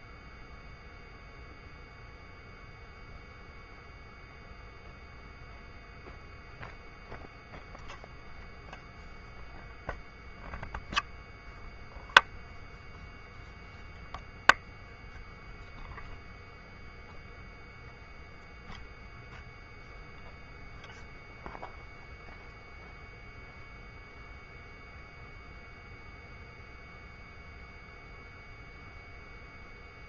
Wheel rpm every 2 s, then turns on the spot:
0, 0, 0, 0, 0, 0, 0, 0, 0, 0, 0, 0, 0, 0, 0.
none